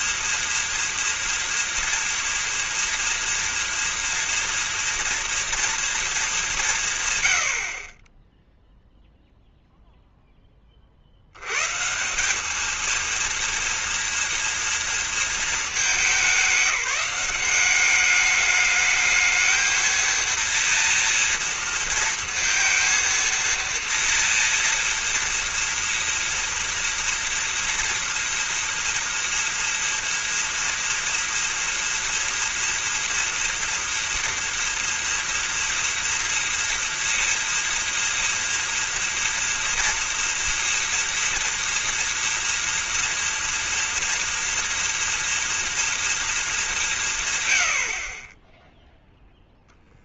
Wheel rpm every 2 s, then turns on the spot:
230, 230, 230, 140, 0, 30, 220, 240, 190, 210, 230, 230, 230, 230, 230, 230, 230, 230, 230, 230, 240, 230, 230, 210, 20.
none